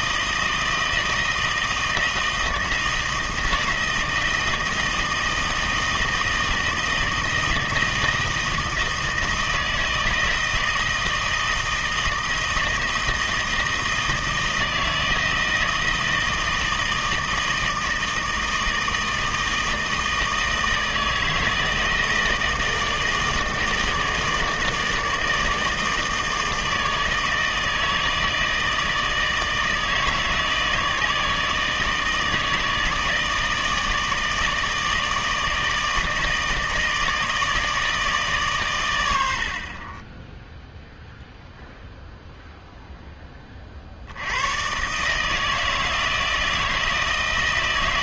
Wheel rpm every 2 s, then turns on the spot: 160, 160, 160, 160, 160, 160, 160, 160, 160, 160, 160, 160, 160, 160, 160, 160, 160, 160, 160, 140, 10, 0, 100, 160.
none